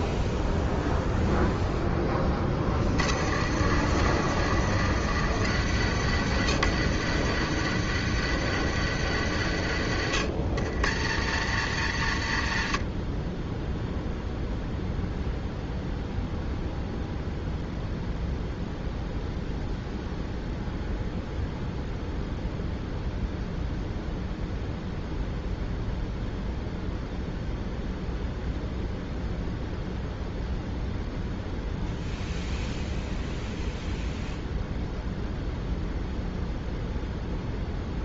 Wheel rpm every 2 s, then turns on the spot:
0, 50, 90, 90, 90, 90, 30, 0, 0, 0, 0, 0, 0, 0, 0, 0, 0, 0, 0.
none